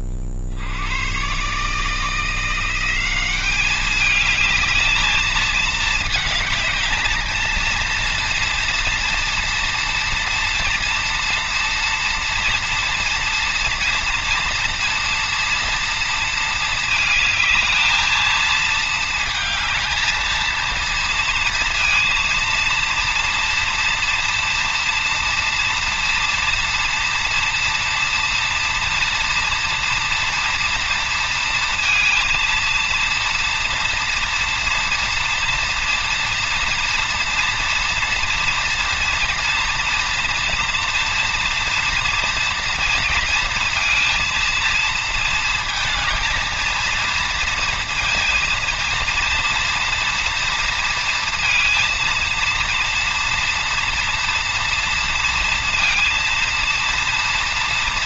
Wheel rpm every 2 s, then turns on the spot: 80, 180, 220, 220, 230, 230, 230, 230, 220, 220, 230, 230, 230, 230, 230, 240, 230, 230, 230, 230, 230, 230, 230, 230, 230, 230, 230, 240, 230.
none